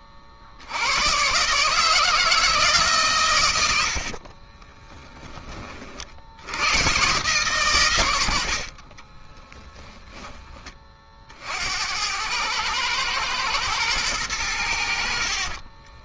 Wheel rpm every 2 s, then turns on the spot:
140, 100, 40, 110, 10, 90, 110, 40.
8-10 14-16